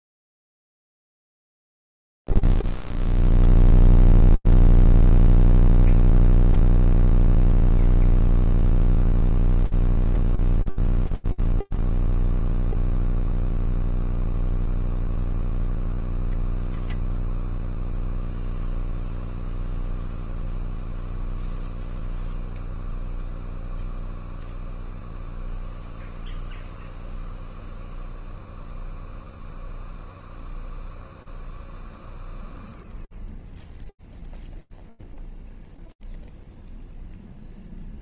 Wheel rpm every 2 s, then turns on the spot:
0, 0, 0, 0, 0, 0, 0, 0, 0, 0, 0, 0, 0, 0, 0, 0, 0, 0, 0.
none